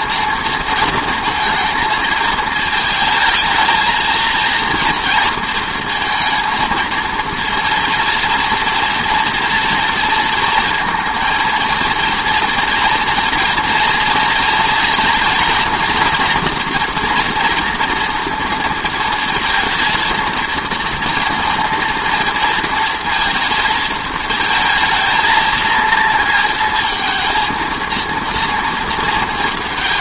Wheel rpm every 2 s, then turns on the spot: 230, 220, 230, 230, 230, 230, 230, 230, 240, 230, 230, 230, 230, 230, 220.
none